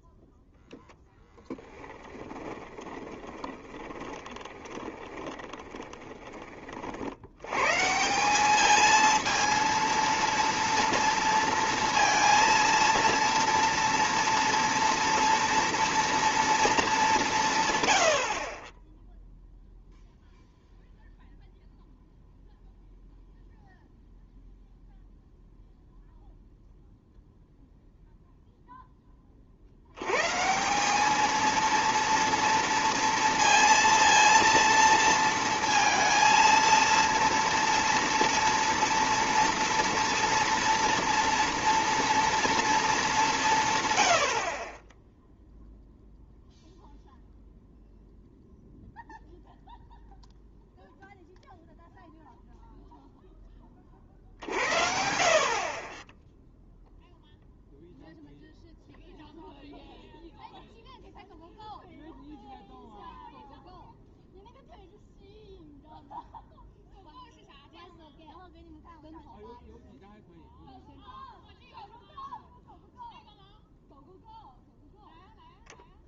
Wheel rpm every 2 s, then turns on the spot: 0, 20, 20, 50, 220, 230, 230, 230, 210, 20, 0, 0, 0, 0, 0, 180, 230, 230, 230, 230, 230, 220, 30, 0, 0, 0, 0, 60, 0, 0, 0, 0, 0, 0, 0, 0, 0, 0.
2-6